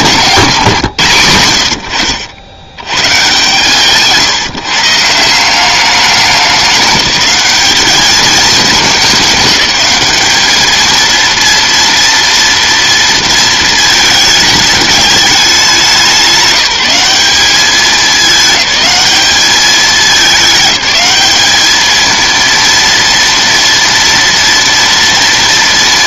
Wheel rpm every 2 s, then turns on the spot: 120, 110, 150, 200, 210, 220, 230, 210, 190, 210, 210, 230, 230.
none